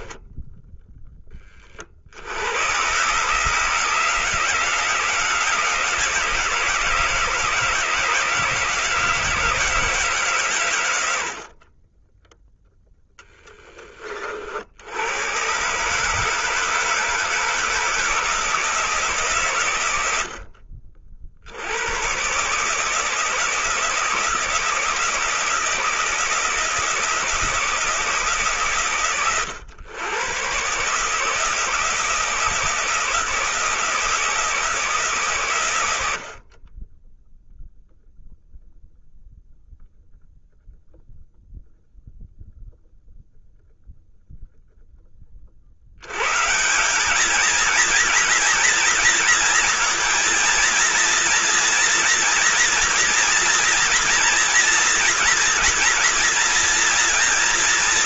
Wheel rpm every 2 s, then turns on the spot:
10, 120, 170, 160, 160, 110, 10, 80, 160, 160, 50, 150, 160, 160, 150, 130, 160, 160, 40, 0, 0, 0, 0, 170, 230, 230, 230, 240, 240.
none